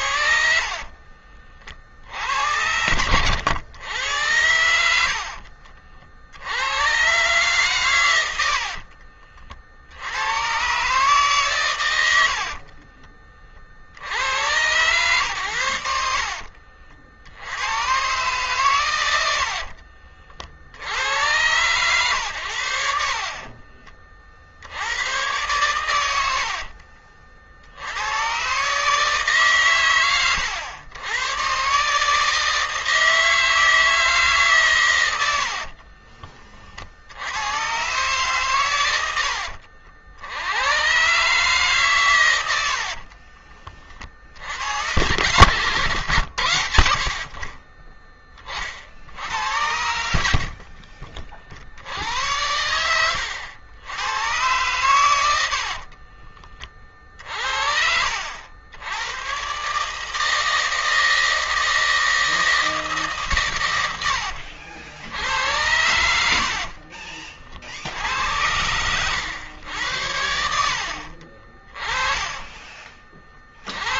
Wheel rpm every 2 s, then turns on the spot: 40, 80, 90, 80, 80, 120, 50, 110, 50, 120, 70, 90, 60, 60, 130, 100, 160, 140, 40, 120, 100, 90, 80, 100, 40, 60, 100, 110, 60, 80, 160, 160, 80, 60, 90, 70, 20.
0-4 8-10 12-14 26-28 42-44 50-54 56-58 66-68